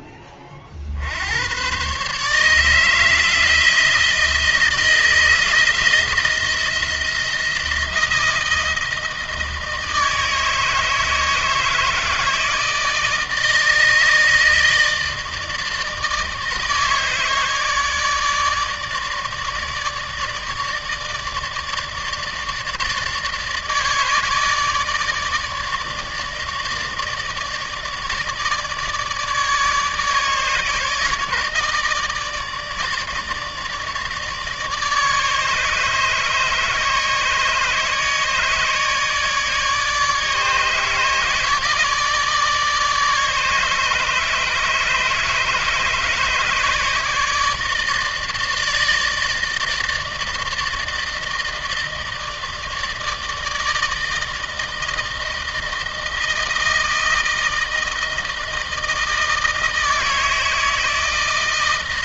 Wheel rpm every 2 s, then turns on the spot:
60, 160, 170, 170, 160, 160, 160, 160, 150, 150, 160, 150, 150, 150, 150, 150, 150, 150, 150, 150, 160, 150, 150, 150, 160, 160, 150, 160, 160, 160, 160.
none